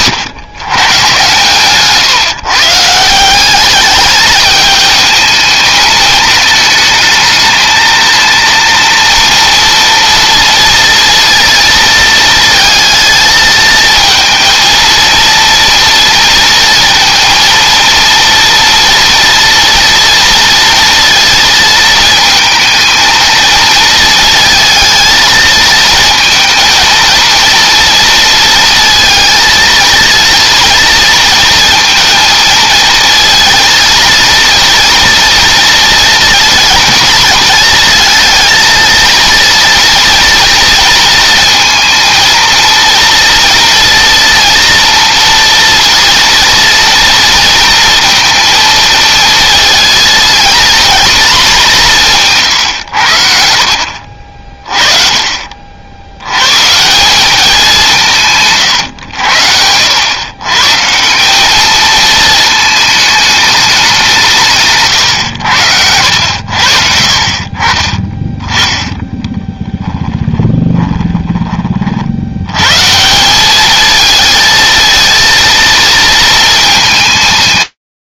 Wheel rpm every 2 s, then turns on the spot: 130, 190, 220, 220, 230, 230, 220, 230, 230, 230, 230, 220, 230, 230, 230, 230, 230, 230, 220, 230, 230, 230, 230, 230, 220, 200, 60, 50, 200, 90, 200, 210, 90, 40, 10, 20, 190, 230, 140.
0-2 68-72